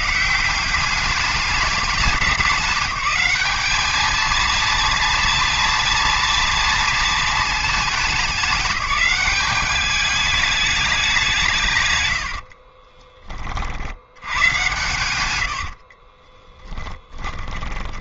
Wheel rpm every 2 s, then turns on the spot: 200, 210, 230, 230, 200, 210, 40, 120, 10.
12-14 16-18